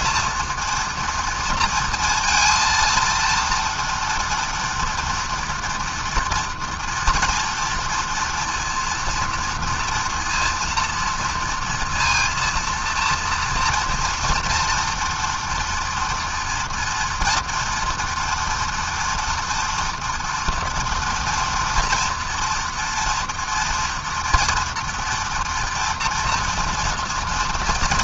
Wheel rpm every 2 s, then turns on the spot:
230, 230, 230, 230, 230, 230, 230, 230, 230, 230, 230, 230, 230, 240.
none